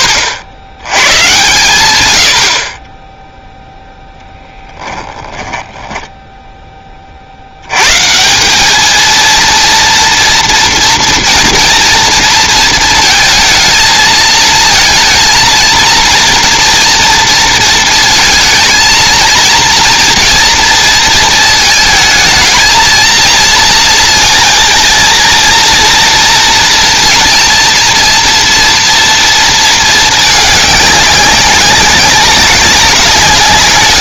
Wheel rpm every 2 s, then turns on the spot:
80, 10, 10, 30, 220, 240, 230, 230, 230, 220, 230, 220, 230, 230, 230, 200, 190.
4-6